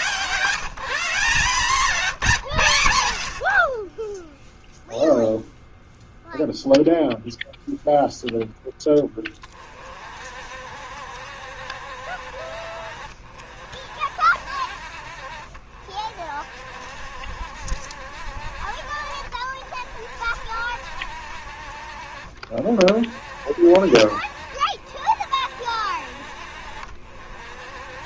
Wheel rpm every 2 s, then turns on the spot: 180, 130, 0, 0, 10, 60, 60, 60, 60, 50, 60, 50, 50, 60.
none